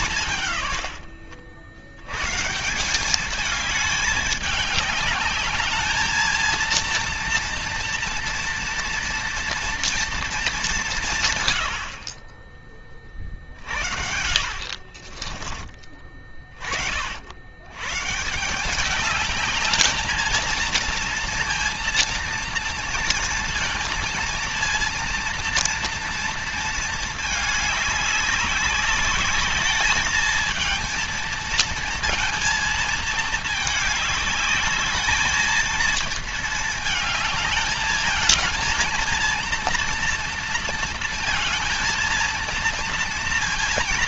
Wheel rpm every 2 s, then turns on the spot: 120, 180, 210, 230, 230, 200, 30, 50, 30, 180, 220, 230, 230, 230, 200, 220, 220, 210, 220, 220, 230, 230.
14-16